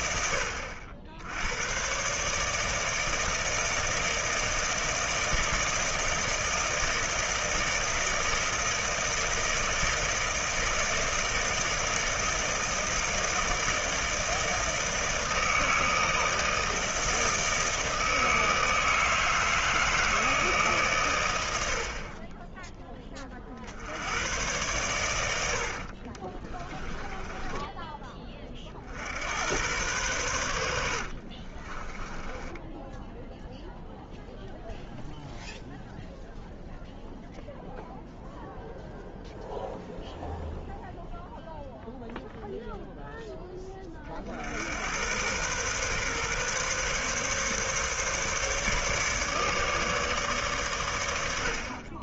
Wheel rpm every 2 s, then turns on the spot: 80, 160, 160, 160, 160, 160, 160, 160, 160, 160, 130, 20, 100, 10, 70, 70, 10, 0, 0, 0, 0, 0, 60, 140, 150, 120.
26-28 30-34